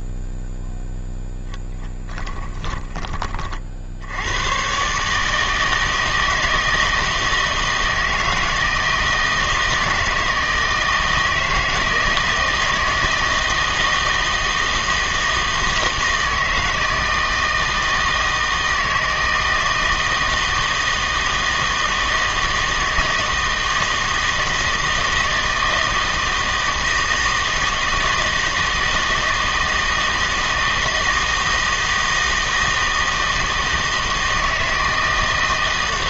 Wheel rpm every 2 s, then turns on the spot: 0, 10, 120, 160, 160, 160, 160, 160, 160, 160, 160, 160, 160, 160, 160, 160, 160, 160.
none